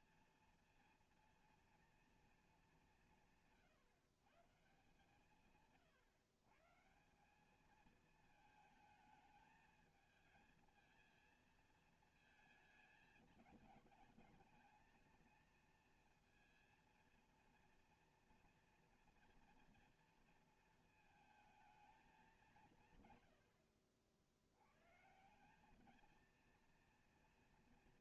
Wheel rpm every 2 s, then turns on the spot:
230, 210, 140, 140, 220, 220, 220, 220, 230, 230, 230, 170, 90, 230.
none